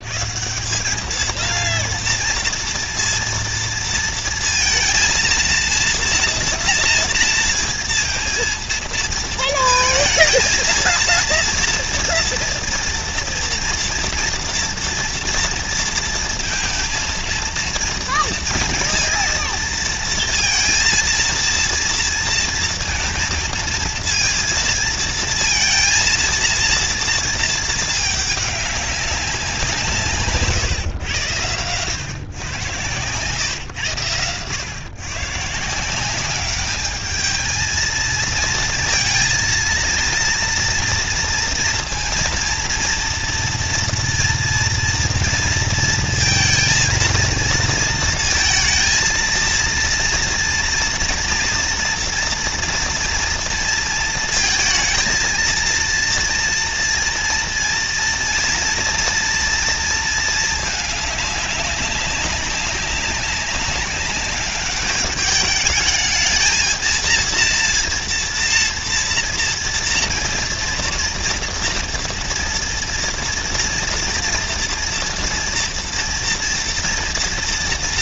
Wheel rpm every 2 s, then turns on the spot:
200, 230, 230, 230, 230, 230, 230, 240, 230, 230, 230, 230, 230, 230, 200, 120, 130, 120, 210, 230, 230, 230, 230, 230, 230, 230, 230, 230, 230, 230, 210, 190, 200, 220, 230, 230, 230, 230, 240.
none